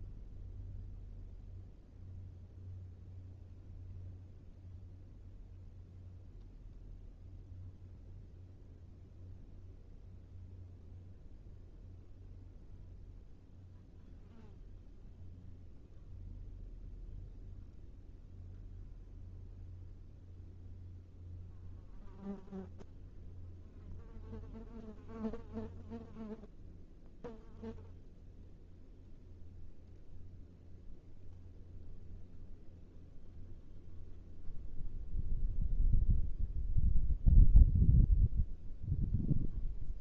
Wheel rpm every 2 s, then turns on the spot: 0, 0, 0, 0, 0, 0, 0, 0, 0, 0, 0, 0, 0, 0, 0, 0, 0, 0, 0, 0.
none